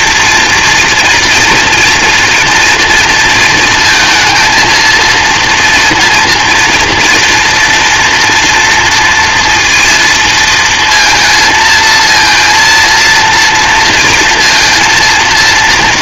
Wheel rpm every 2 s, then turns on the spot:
230, 230, 230, 230, 240, 230, 230, 230.
none